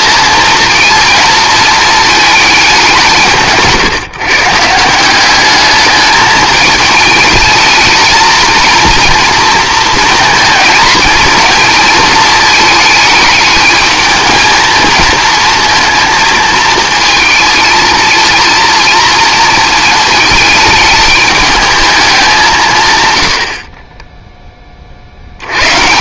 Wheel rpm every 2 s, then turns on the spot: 230, 210, 160, 210, 230, 230, 220, 220, 220, 230, 210, 160, 20.
none